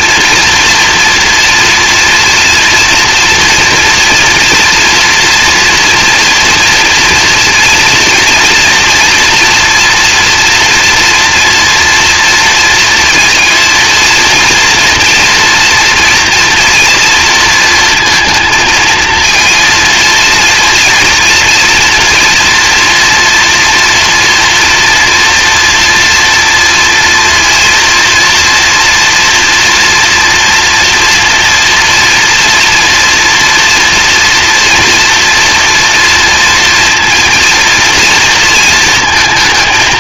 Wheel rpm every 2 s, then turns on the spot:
230, 230, 240, 230, 230, 230, 230, 230, 230, 230, 230, 240, 230, 230, 230, 240, 230, 230, 230, 230.
none